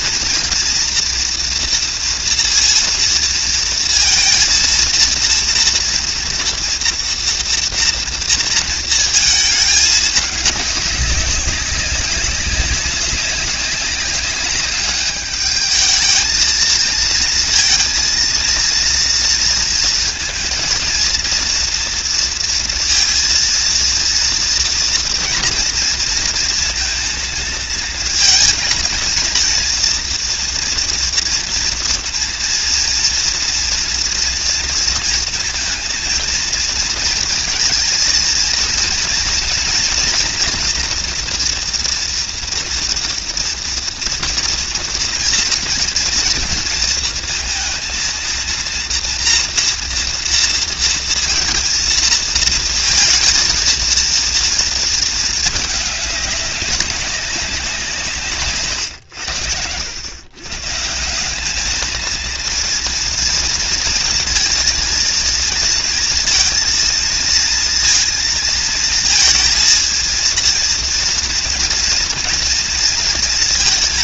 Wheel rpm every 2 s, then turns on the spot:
230, 230, 230, 230, 230, 200, 200, 200, 220, 230, 230, 230, 230, 230, 230, 230, 230, 230, 230, 230, 240, 230, 230, 230, 230, 230, 230, 220, 200, 100, 170, 230, 230, 230, 230, 230, 230.
none